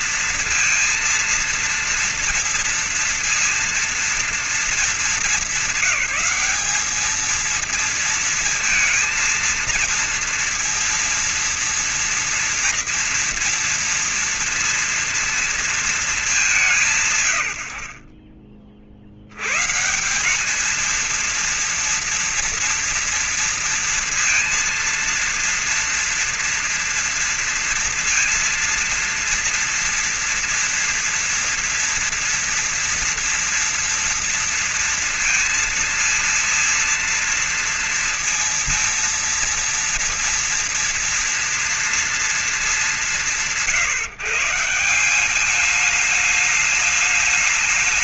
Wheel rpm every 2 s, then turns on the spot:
230, 230, 220, 200, 230, 230, 230, 230, 180, 50, 200, 230, 230, 230, 230, 230, 230, 230, 230, 230, 230, 220, 160, 210.
none